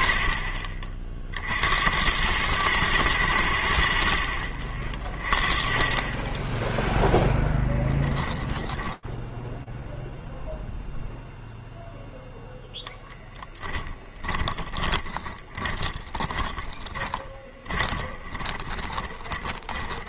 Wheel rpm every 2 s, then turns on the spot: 40, 110, 40, 10, 10, 0, 0, 20, 30, 20.
6-10 14-20